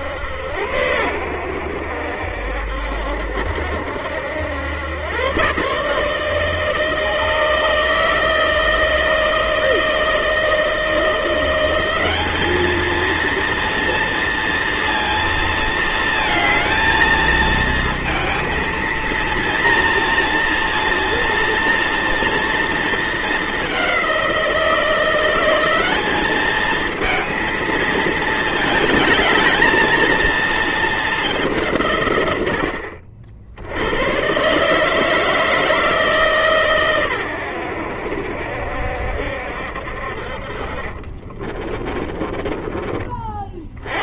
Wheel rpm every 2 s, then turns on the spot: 90, 70, 90, 160, 160, 160, 210, 230, 220, 230, 230, 230, 180, 210, 220, 220, 90, 140, 150, 70, 50, 20.
40-44